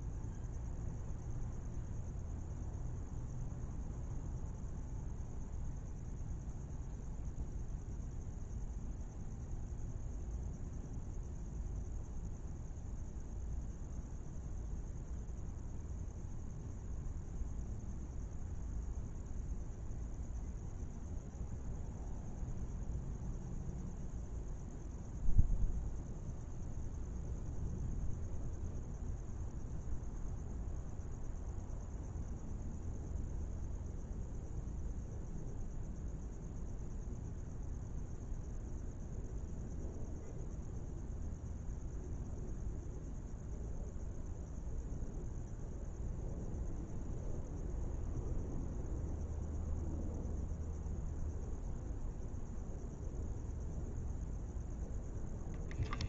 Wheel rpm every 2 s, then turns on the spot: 0, 0, 0, 0, 0, 0, 0, 0, 0, 0, 0, 0, 0, 0, 0, 0, 0, 0, 0, 0, 0, 0, 0, 0, 0, 0, 0, 0.
none